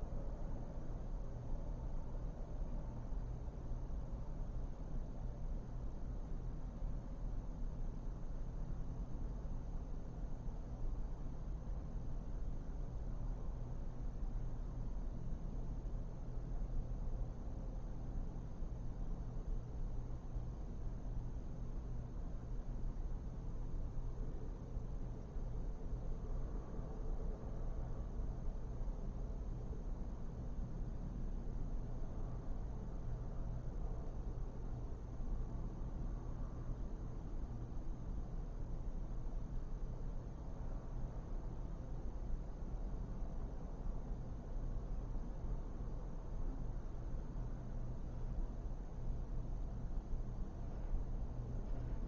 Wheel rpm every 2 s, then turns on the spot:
0, 0, 0, 0, 0, 0, 0, 0, 0, 0, 0, 0, 0, 0, 0, 0, 0, 0, 0, 0, 0, 0, 0, 0, 0, 0.
none